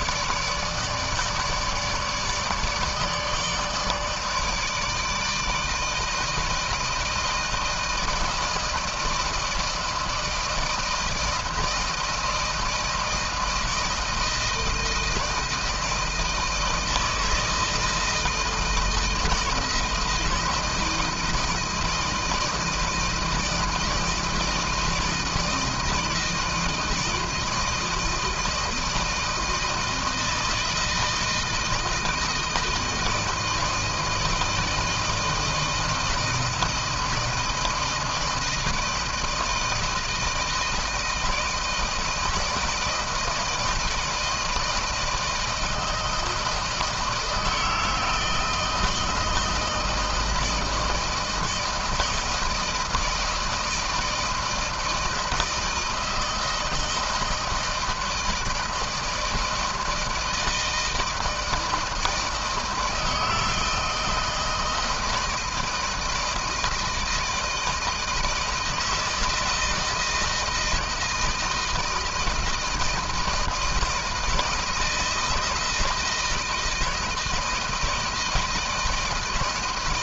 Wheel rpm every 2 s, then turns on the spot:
160, 150, 150, 160, 160, 160, 160, 160, 160, 160, 160, 160, 160, 160, 160, 160, 160, 160, 170, 160, 160, 160, 170, 160, 160, 160, 160, 160, 160, 160, 160, 160, 160, 160, 160, 160, 160, 160, 160, 160.
none